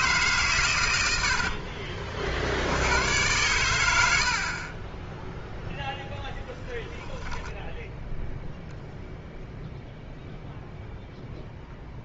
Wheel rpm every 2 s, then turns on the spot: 120, 80, 20, 0, 0, 0.
none